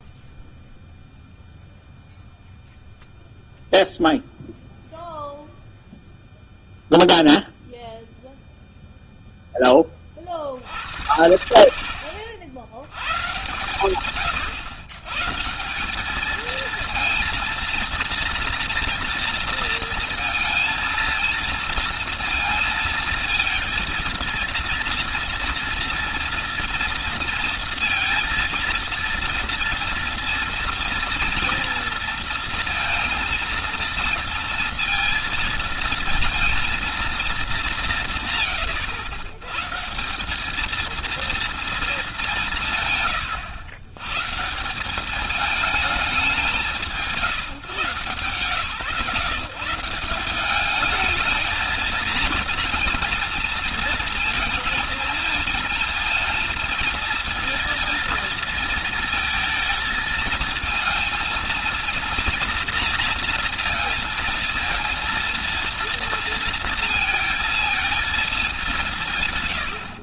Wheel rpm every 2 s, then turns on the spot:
0, 0, 0, 0, 0, 60, 130, 140, 230, 230, 230, 230, 230, 230, 230, 230, 230, 230, 200, 100, 230, 110, 210, 150, 150, 220, 230, 220, 230, 230, 230, 230, 230, 230, 140.
none